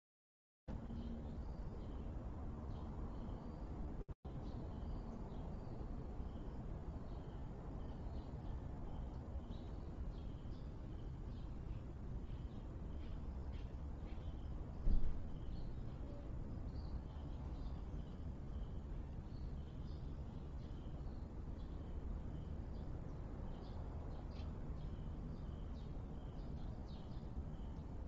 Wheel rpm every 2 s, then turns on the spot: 0, 0, 0, 0, 0, 0, 0, 0, 0, 0, 0, 0, 0, 0.
none